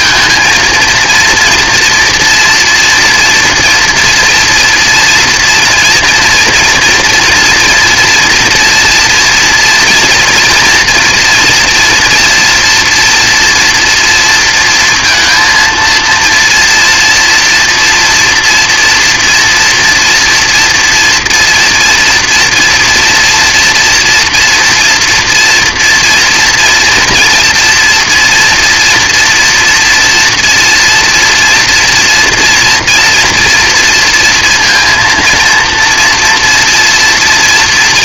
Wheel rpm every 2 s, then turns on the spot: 230, 230, 230, 240, 230, 230, 230, 230, 230, 230, 240, 230, 230, 240, 230, 230, 230, 230, 230.
none